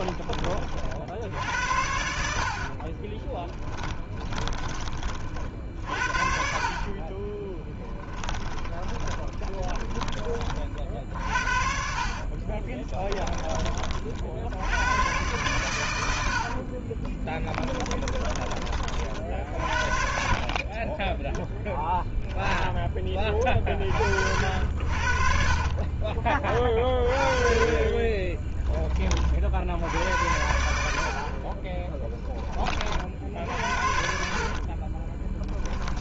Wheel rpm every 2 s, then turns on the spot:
40, 50, 20, 50, 20, 40, 40, 80, 60, 40, 40, 10, 70, 30, 10, 90, 30, 40.
2-4 6-10 12-14 16-18 20-26 34-36